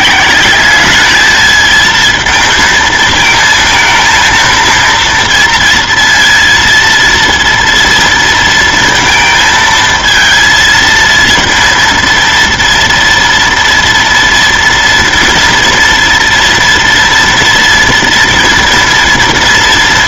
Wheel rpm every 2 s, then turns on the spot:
210, 230, 230, 230, 230, 230, 230, 230, 230, 230.
none